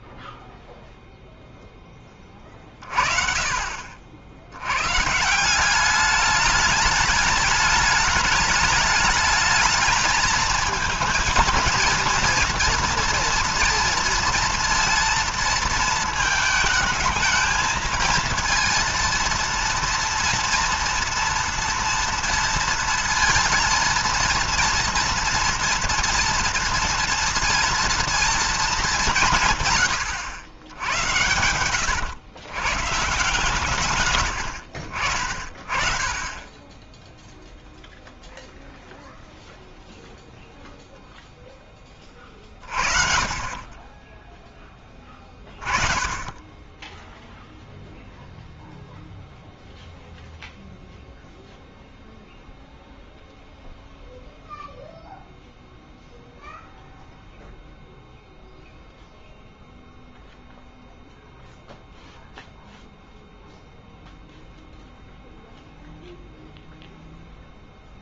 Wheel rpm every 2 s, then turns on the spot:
0, 30, 90, 210, 210, 220, 230, 230, 220, 230, 230, 230, 230, 230, 220, 100, 130, 80, 20, 0, 0, 50, 10, 20, 0, 0, 0, 0, 0, 0, 0, 0, 0, 0.
none